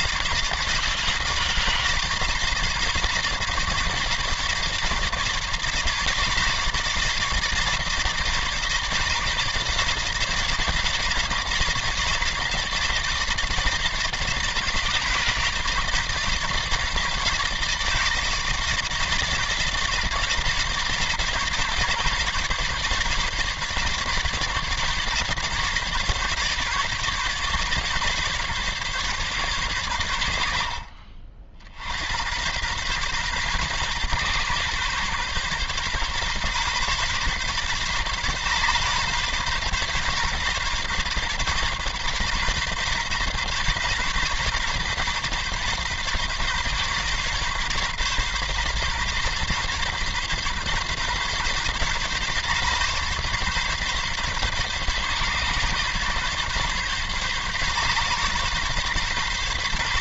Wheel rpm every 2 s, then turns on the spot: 160, 160, 150, 150, 160, 150, 160, 150, 150, 160, 150, 150, 150, 140, 140, 50, 110, 130, 140, 140, 140, 140, 140, 130, 140, 130, 140, 130, 130, 140.
none